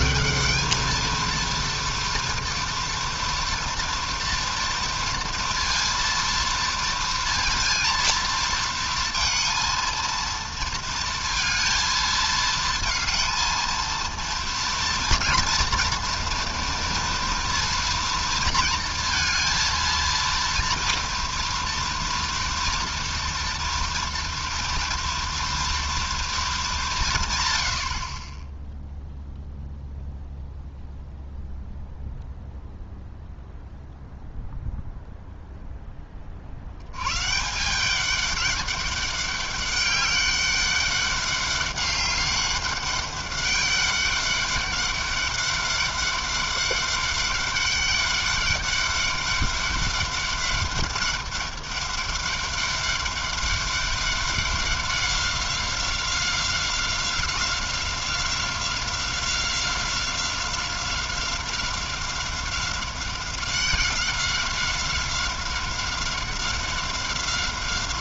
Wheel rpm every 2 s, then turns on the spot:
230, 230, 230, 230, 220, 230, 230, 230, 230, 230, 230, 230, 230, 140, 0, 0, 0, 0, 140, 200, 200, 200, 200, 200, 200, 200, 200, 190, 190, 190, 190, 190, 190, 190.
none